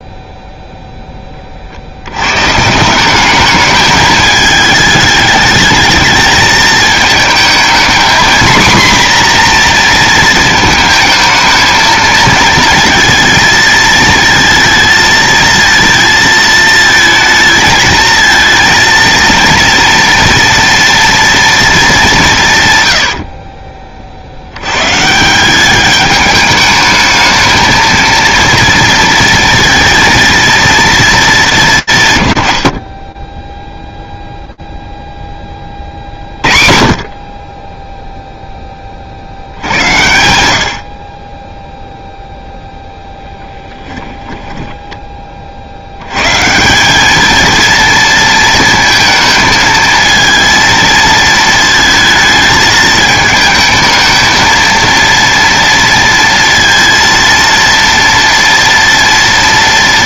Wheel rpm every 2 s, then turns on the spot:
0, 130, 210, 220, 240, 220, 220, 220, 220, 220, 230, 120, 90, 210, 230, 230, 120, 0, 40, 10, 70, 0, 20, 210, 220, 220, 220, 230, 230, 230.
none